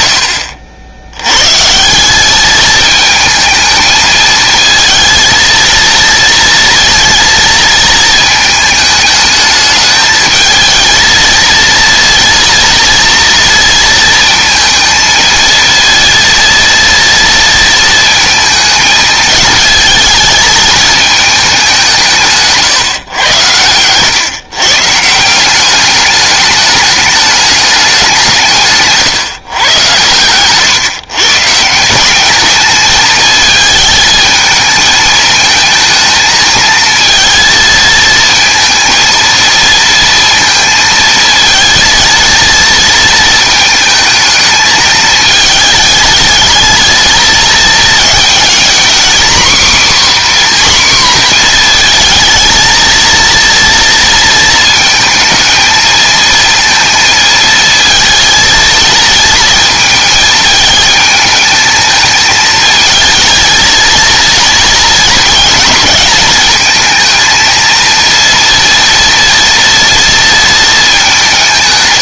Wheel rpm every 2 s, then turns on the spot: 70, 220, 230, 230, 220, 220, 230, 230, 230, 220, 220, 140, 130, 210, 150, 120, 210, 220, 220, 230, 230, 230, 220, 220, 230, 260, 230, 220, 220, 230, 220, 220, 230, 230, 230, 220.
none